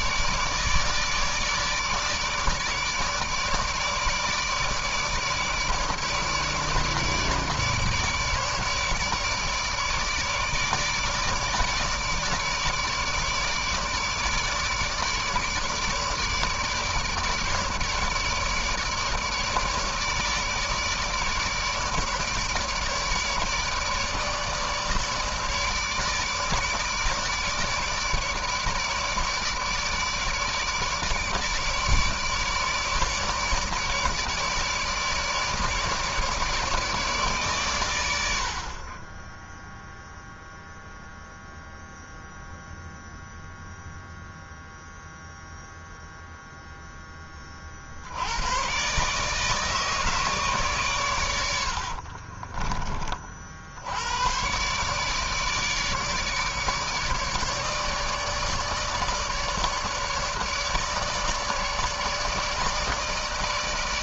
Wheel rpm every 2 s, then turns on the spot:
150, 150, 150, 150, 150, 150, 150, 150, 150, 150, 150, 150, 150, 150, 150, 150, 150, 150, 150, 60, 0, 0, 0, 0, 90, 140, 40, 120, 150, 150, 150, 160.
52-54